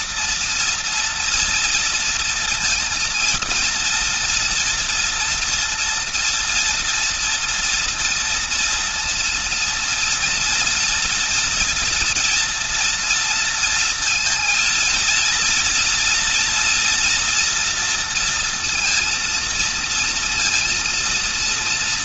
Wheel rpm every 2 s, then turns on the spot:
240, 230, 230, 230, 230, 230, 230, 230, 230, 230, 230.
none